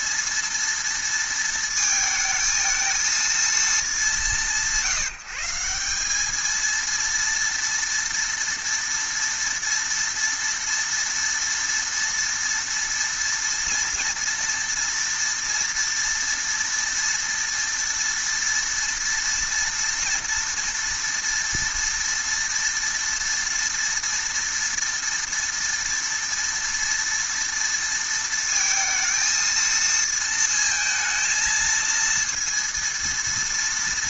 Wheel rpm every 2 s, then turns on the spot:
230, 220, 170, 220, 230, 230, 230, 230, 230, 230, 230, 230, 230, 230, 220, 230, 230.
none